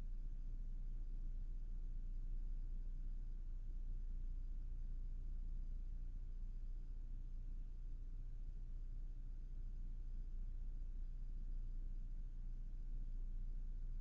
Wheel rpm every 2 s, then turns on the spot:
0, 0, 0, 0, 0, 0, 0.
none